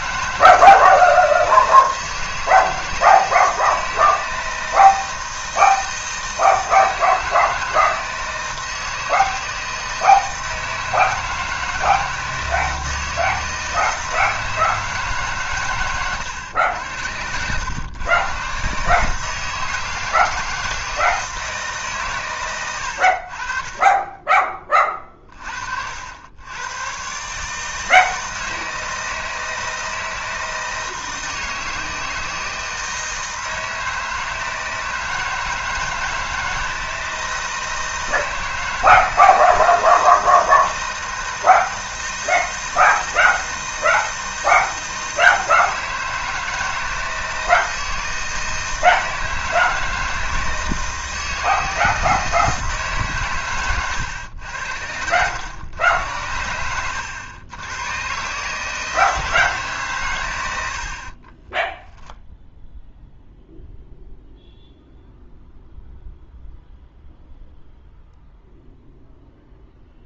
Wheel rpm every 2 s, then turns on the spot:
160, 160, 160, 160, 160, 160, 160, 160, 90, 130, 160, 110, 30, 110, 160, 160, 160, 160, 160, 160, 160, 160, 160, 160, 160, 160, 160, 90, 100, 150, 80, 0, 0, 0, 0.
16-18